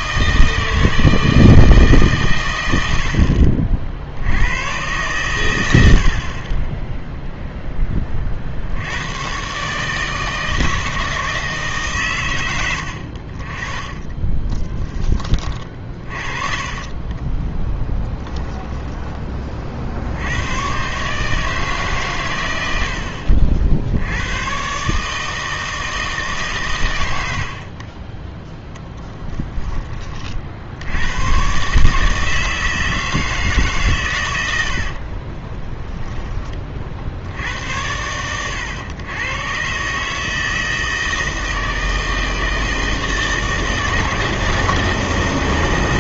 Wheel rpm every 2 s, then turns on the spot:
160, 100, 110, 20, 70, 160, 80, 10, 30, 10, 120, 80, 120, 120, 0, 70, 160, 90, 30, 100, 160, 160, 160.
14-20